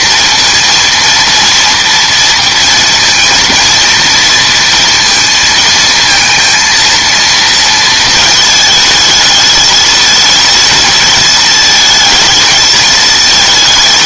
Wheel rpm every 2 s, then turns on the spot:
230, 230, 230, 230, 220, 220, 220.
none